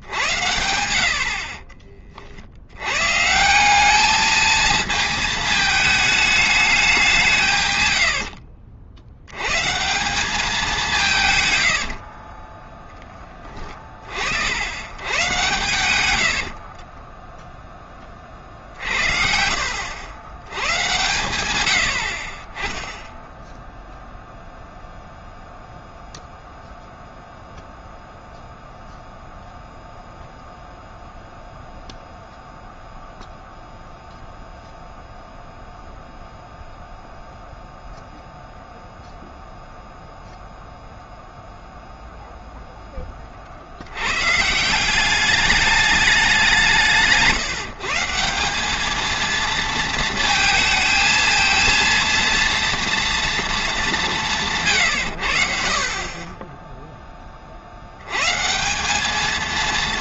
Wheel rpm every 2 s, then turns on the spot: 80, 90, 220, 200, 50, 190, 20, 80, 50, 50, 100, 20, 0, 0, 0, 0, 0, 0, 0, 0, 0, 0, 160, 180, 200, 230, 230, 140, 10, 170.
12-14 16-18